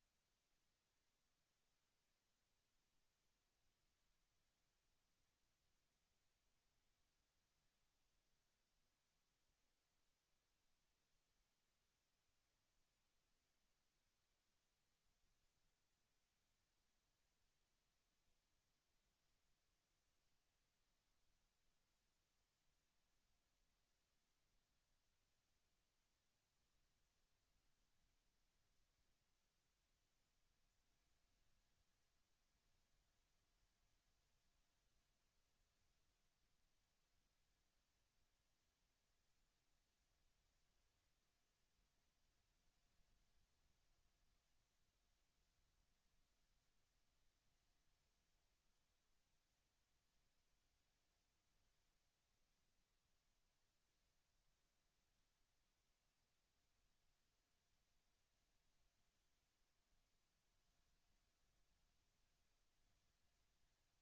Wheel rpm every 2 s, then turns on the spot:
0, 0, 0, 0, 0, 0, 0, 0, 0, 0, 0, 0, 0, 0, 0, 0, 0, 0, 0, 0, 0, 0, 0, 0, 0, 0, 0, 0, 0, 0, 0, 0.
none